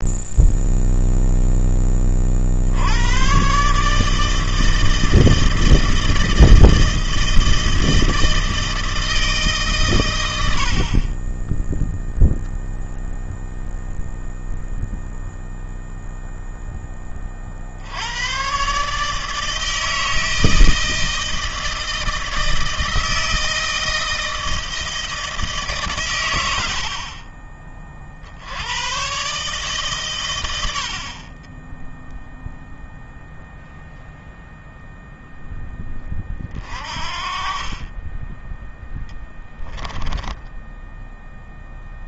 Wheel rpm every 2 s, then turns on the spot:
0, 60, 160, 160, 160, 80, 0, 0, 10, 130, 160, 160, 160, 90, 80, 80, 0, 0, 30, 10, 10.
none